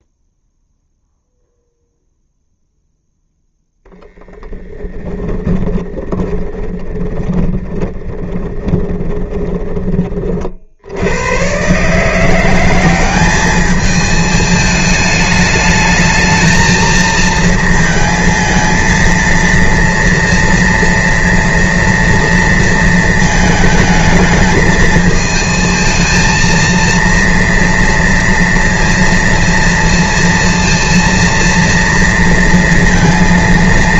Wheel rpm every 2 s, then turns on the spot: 0, 0, 10, 20, 20, 40, 170, 210, 220, 230, 230, 230, 220, 230, 230, 230, 230.
6-10